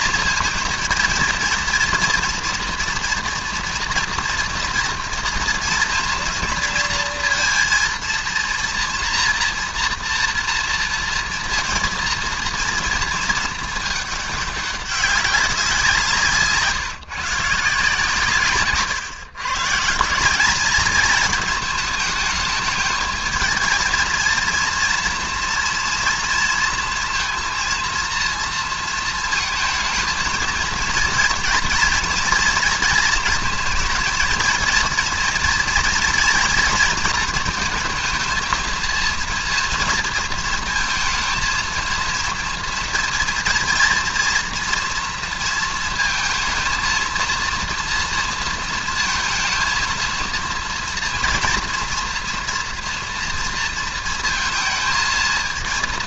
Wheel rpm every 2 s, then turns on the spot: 230, 230, 230, 230, 230, 230, 230, 200, 160, 140, 210, 220, 230, 230, 230, 230, 240, 230, 230, 230, 230, 230, 230, 230, 230, 230, 230, 220.
18-20